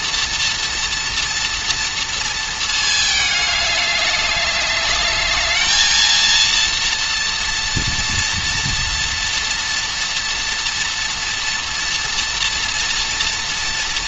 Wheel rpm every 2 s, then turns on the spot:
230, 220, 210, 230, 230, 230, 230.
none